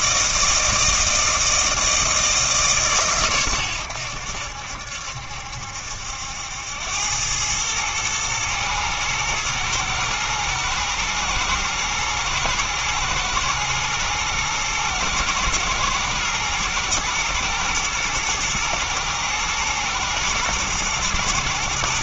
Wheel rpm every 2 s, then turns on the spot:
160, 150, 70, 80, 110, 110, 110, 110, 120, 120, 120.
none